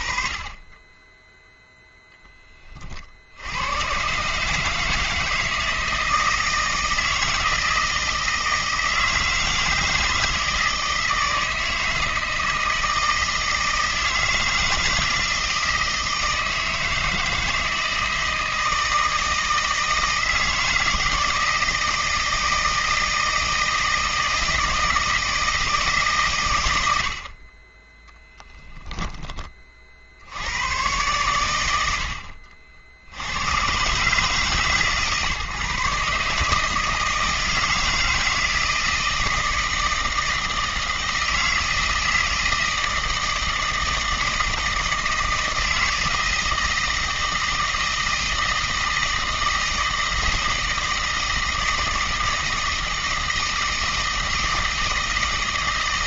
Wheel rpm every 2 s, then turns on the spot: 10, 30, 150, 160, 160, 160, 160, 160, 160, 160, 160, 160, 160, 100, 10, 100, 60, 140, 150, 160, 160, 160, 160, 160, 160, 160, 160, 160.
none